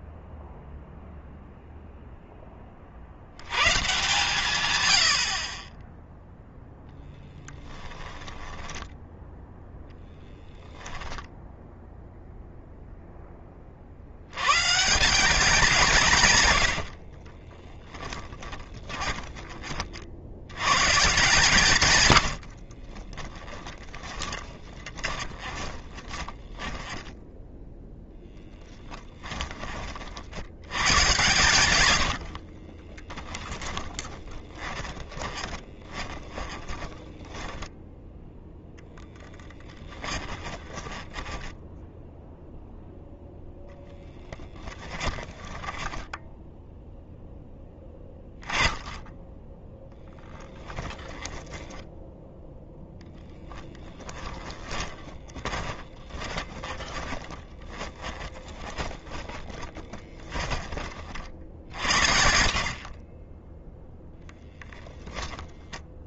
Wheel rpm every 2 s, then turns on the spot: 0, 40, 90, 10, 10, 10, 0, 170, 60, 20, 140, 30, 20, 10, 10, 110, 10, 20, 10, 0, 20, 0, 10, 0, 10, 10, 0, 20, 20, 20, 40, 40, 10.
6-10 16-20 22-28 32-38 40-42 44-46 54-60